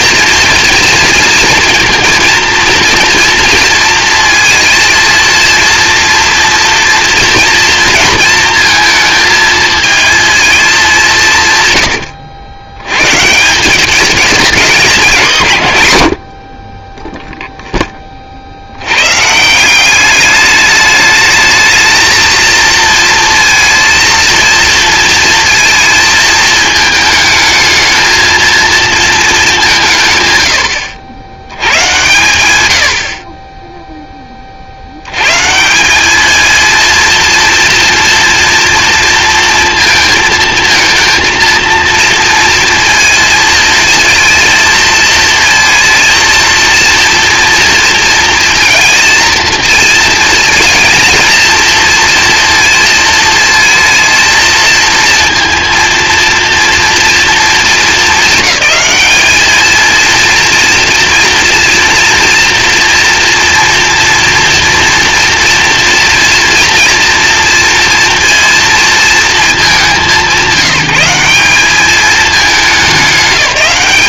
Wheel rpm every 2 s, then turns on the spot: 230, 230, 220, 230, 230, 220, 90, 200, 40, 60, 210, 230, 230, 220, 220, 110, 100, 40, 230, 230, 220, 230, 230, 230, 230, 230, 230, 230, 230, 200, 230, 240, 230, 230, 230, 170, 210.
none